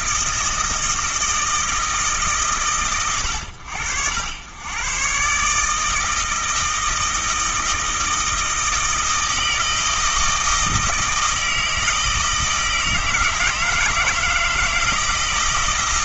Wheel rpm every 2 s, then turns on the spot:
160, 120, 120, 160, 160, 160, 160, 160.
none